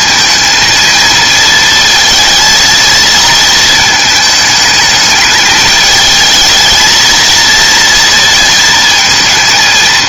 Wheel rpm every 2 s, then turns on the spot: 230, 230, 220, 220, 230.
none